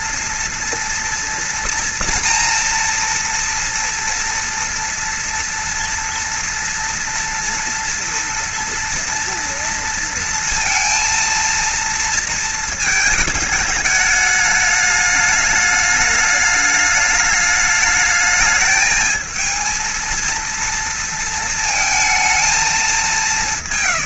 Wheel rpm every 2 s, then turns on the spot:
230, 230, 230, 230, 230, 230, 230, 210, 210, 220, 230, 210.
none